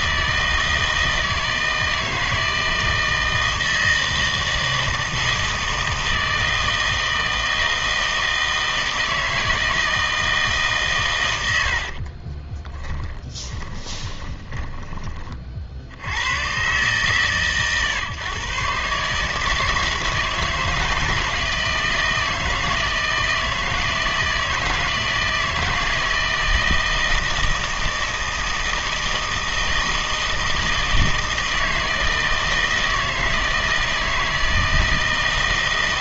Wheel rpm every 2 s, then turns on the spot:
160, 160, 160, 160, 160, 140, 20, 20, 120, 140, 160, 160, 160, 160, 160, 160, 160, 160.
12-16